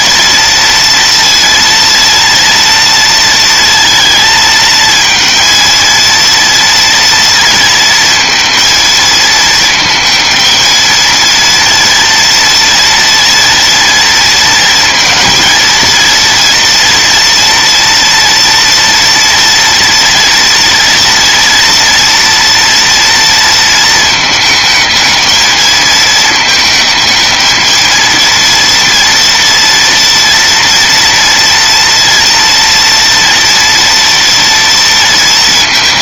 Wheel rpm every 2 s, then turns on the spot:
230, 230, 220, 230, 230, 230, 230, 230, 240, 240, 240, 230, 220, 220, 230, 240, 230, 230.
none